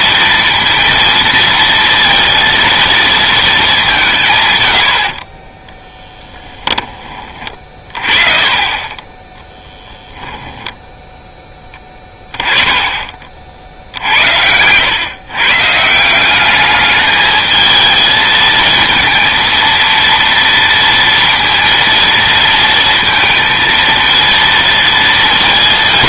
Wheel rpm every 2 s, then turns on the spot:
230, 230, 90, 10, 30, 10, 20, 110, 210, 220, 230, 230, 230.
10-12